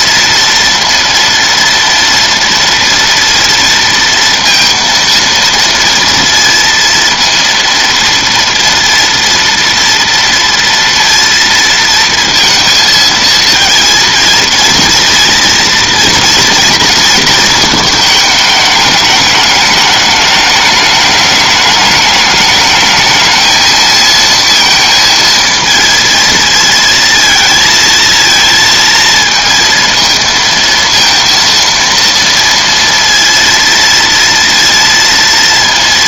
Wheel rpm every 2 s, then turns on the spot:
230, 230, 230, 230, 230, 230, 220, 230, 230, 210, 210, 210, 230, 230, 230, 220, 230, 230.
none